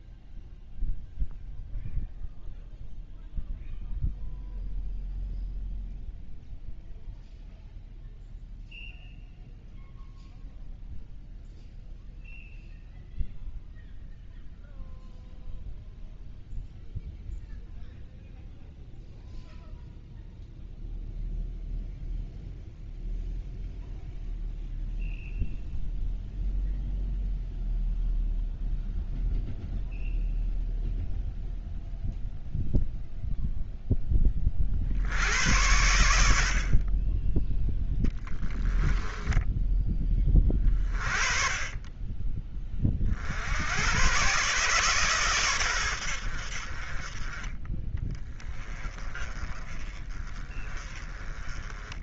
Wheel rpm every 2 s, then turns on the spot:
0, 0, 0, 0, 0, 0, 0, 0, 0, 0, 0, 0, 0, 0, 0, 0, 0, 40, 50, 10, 30, 30, 130, 60, 20, 20.
38-40